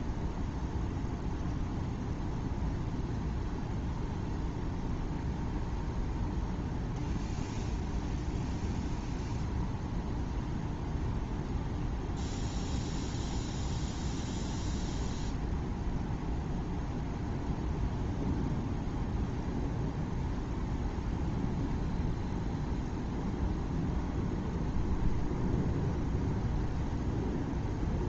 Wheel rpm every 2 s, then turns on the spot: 0, 0, 0, 0, 0, 0, 0, 0, 0, 0, 0, 0, 0, 0.
none